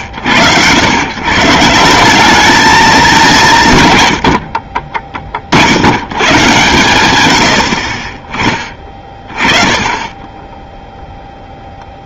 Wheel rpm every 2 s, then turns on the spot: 170, 150, 50, 80, 20, 0.
none